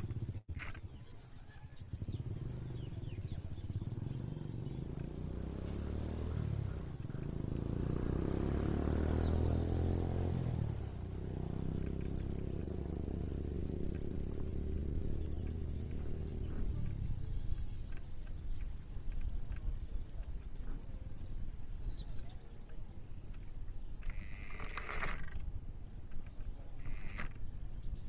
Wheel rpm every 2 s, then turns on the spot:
20, 0, 0, 0, 0, 0, 0, 0, 0, 0, 0, 0, 0, 0.
none